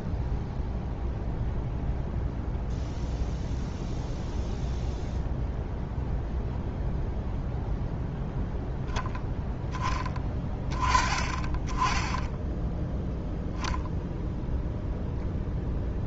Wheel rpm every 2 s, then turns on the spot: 0, 0, 0, 0, 0, 20, 10, 0.
none